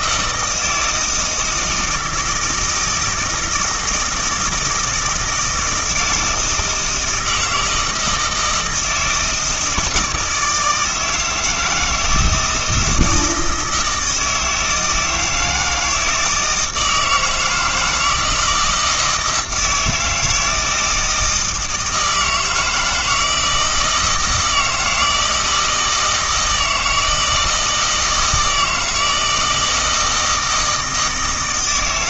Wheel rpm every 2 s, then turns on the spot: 160, 160, 160, 160, 160, 160, 160, 160, 160, 160, 160, 170, 160, 160, 160, 160.
none